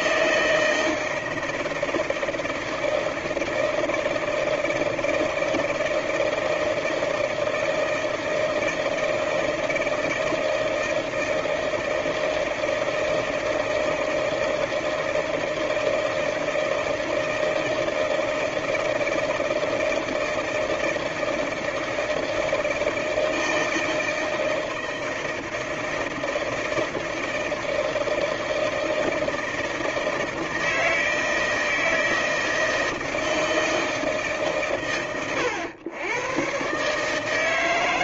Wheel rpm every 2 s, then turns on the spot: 160, 160, 160, 160, 160, 160, 160, 160, 160, 160, 160, 160, 160, 160, 160, 160, 160, 130, 120.
none